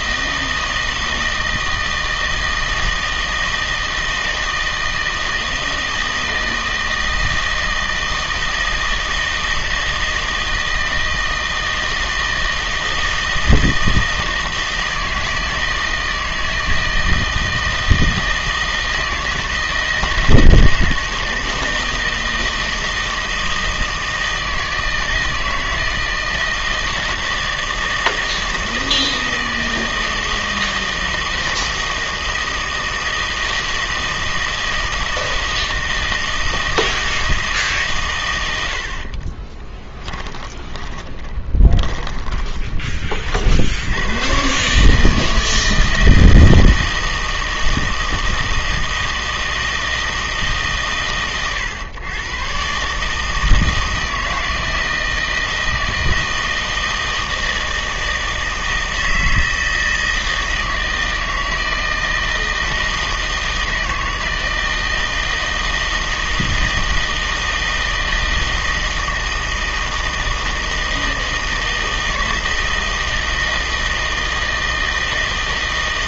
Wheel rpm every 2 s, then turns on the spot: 160, 160, 160, 160, 160, 160, 160, 160, 160, 160, 160, 160, 160, 160, 160, 160, 160, 160, 160, 80, 20, 20, 140, 160, 160, 150, 140, 160, 160, 160, 160, 160, 160, 160, 160, 160, 160, 160.
40-42